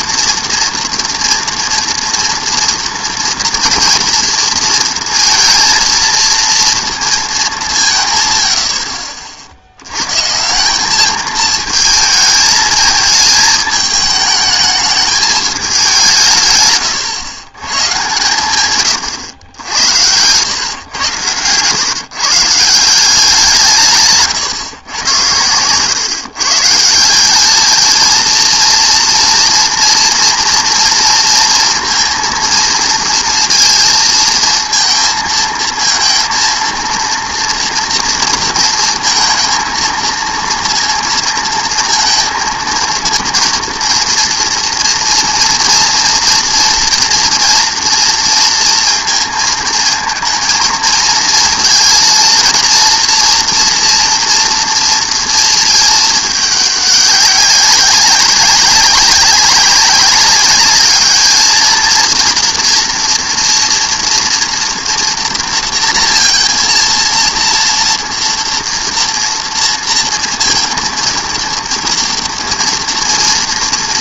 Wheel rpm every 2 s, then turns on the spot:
240, 240, 230, 230, 90, 160, 220, 210, 140, 130, 110, 150, 140, 140, 230, 230, 230, 230, 230, 230, 230, 220, 230, 230, 230, 230, 230, 230, 210, 200, 200, 230, 230, 230, 230, 230, 240.
none